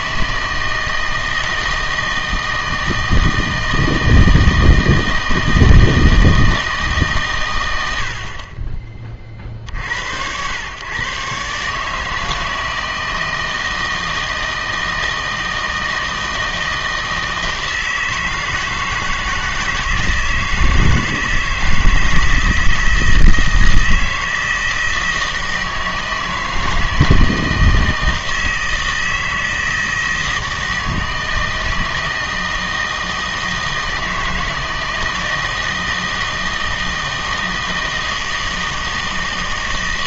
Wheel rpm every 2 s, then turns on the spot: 160, 160, 160, 160, 30, 100, 160, 160, 160, 160, 160, 160, 160, 160, 160, 160, 160, 160, 160, 160.
none